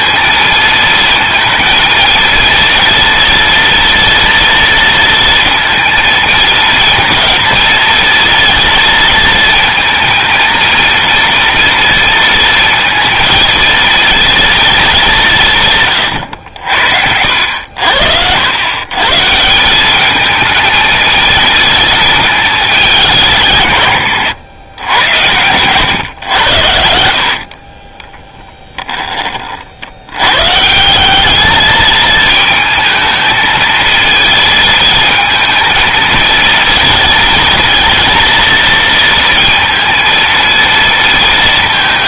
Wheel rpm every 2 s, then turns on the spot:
230, 230, 230, 230, 230, 230, 220, 220, 80, 110, 220, 200, 100, 80, 10, 160, 220, 220, 230, 230, 230.
26-30